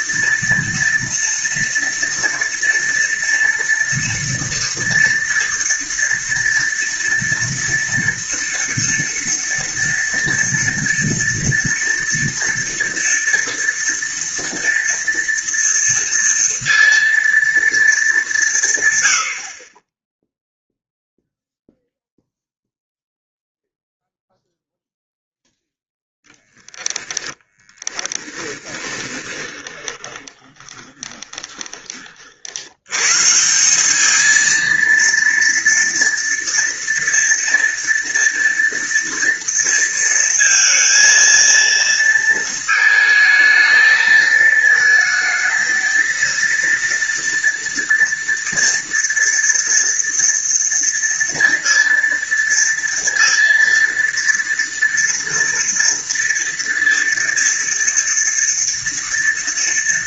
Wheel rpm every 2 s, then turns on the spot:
230, 240, 230, 240, 230, 230, 230, 230, 230, 130, 0, 0, 0, 0, 10, 20, 90, 230, 230, 230, 230, 220, 220, 230, 230, 230, 230, 230, 230, 230.
28-32